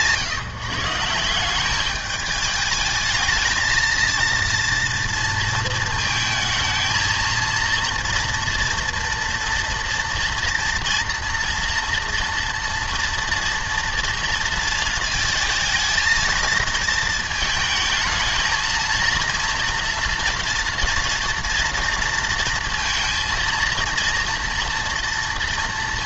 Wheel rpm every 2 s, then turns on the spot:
160, 210, 230, 230, 230, 230, 230, 230, 220, 220, 230, 230, 230.
none